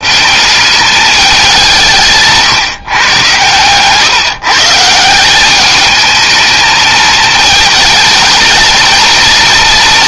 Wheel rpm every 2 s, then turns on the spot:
200, 150, 160, 220, 230.
none